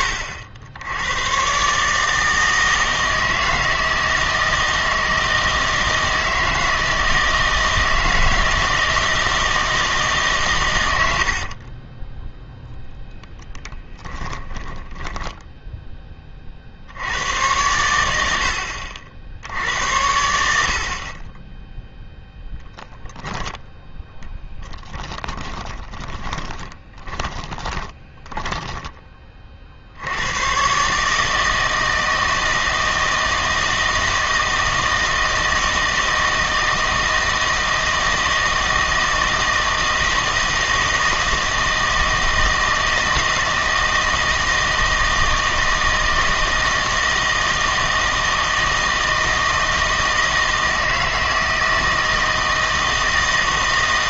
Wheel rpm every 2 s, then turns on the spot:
90, 160, 160, 160, 160, 90, 0, 10, 60, 60, 60, 0, 10, 20, 10, 130, 160, 160, 160, 160, 160, 160, 160, 160, 160, 160, 160.
14-16 24-28